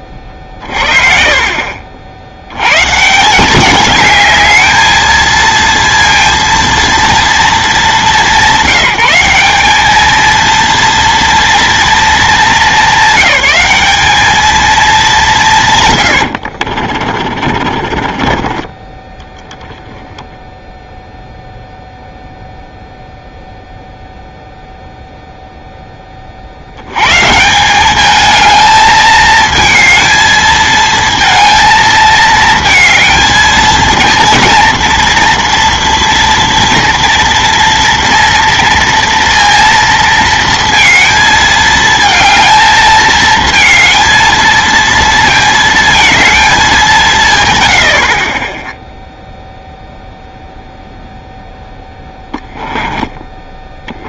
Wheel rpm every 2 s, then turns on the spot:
30, 100, 220, 230, 190, 230, 220, 220, 50, 20, 0, 0, 0, 70, 220, 220, 220, 230, 230, 230, 230, 220, 230, 190, 10, 0, 10.
16-18 52-54